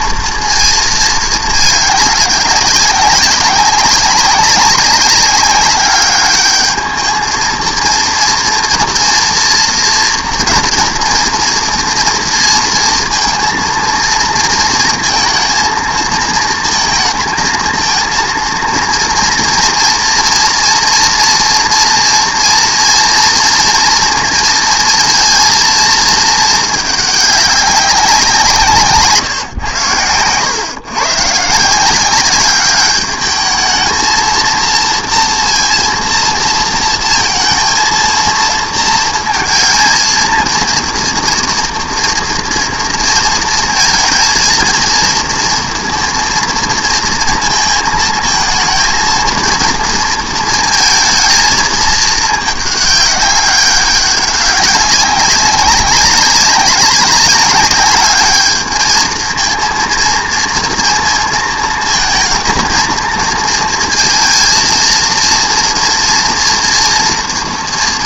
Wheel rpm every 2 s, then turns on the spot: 230, 190, 200, 210, 230, 230, 230, 230, 230, 230, 230, 240, 240, 220, 170, 120, 200, 230, 230, 230, 230, 230, 230, 230, 230, 230, 210, 190, 190, 220, 230, 220, 230, 230.
none